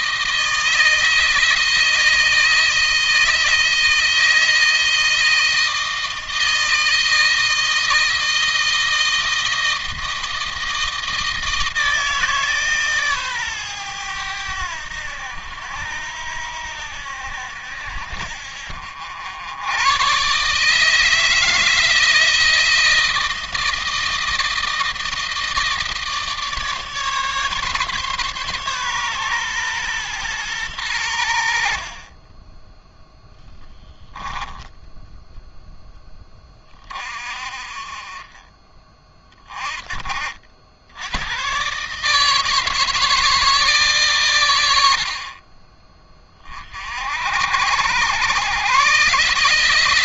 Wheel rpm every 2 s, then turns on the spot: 160, 160, 160, 160, 160, 160, 150, 90, 80, 70, 160, 160, 160, 150, 140, 100, 10, 10, 40, 30, 80, 160, 70, 50, 130.
none